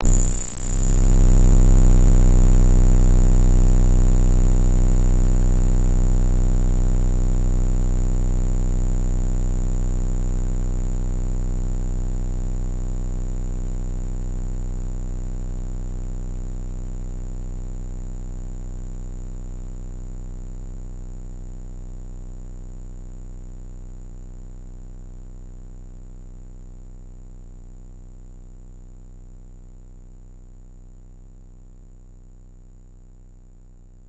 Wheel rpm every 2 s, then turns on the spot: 0, 0, 0, 0, 0, 0, 0, 0, 0, 10, 20, 10, 20, 0, 0, 0, 0.
18-26